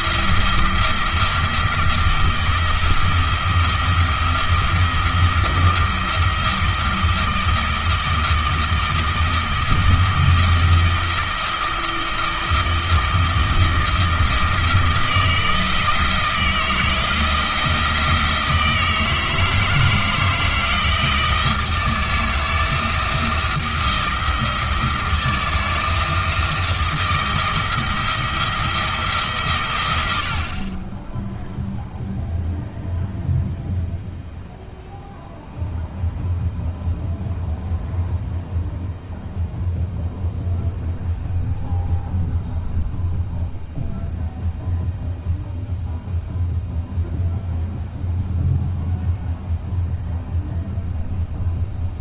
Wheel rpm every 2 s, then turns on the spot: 170, 170, 170, 160, 160, 160, 160, 160, 170, 160, 160, 160, 170, 160, 160, 30, 0, 0, 0, 0, 0, 0, 0, 0, 0, 0.
none